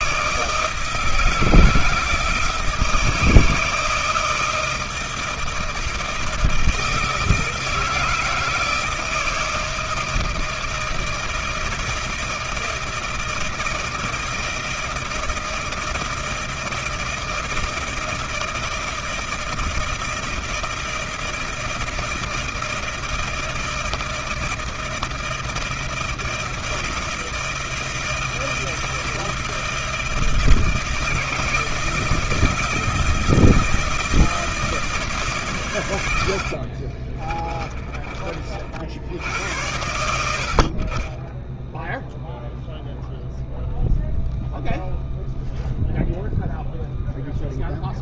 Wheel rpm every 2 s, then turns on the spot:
160, 160, 160, 170, 160, 160, 160, 160, 160, 160, 160, 160, 160, 160, 160, 160, 160, 160, 60, 30, 70, 0, 0, 0.
36-38